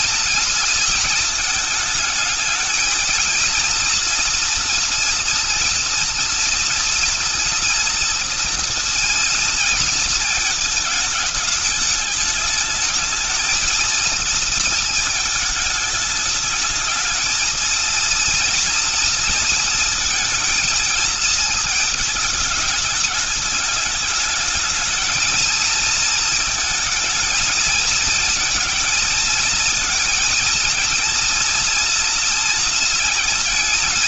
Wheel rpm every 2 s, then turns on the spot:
220, 220, 230, 230, 230, 220, 220, 220, 220, 230, 220, 210, 220, 220, 230, 230, 230.
none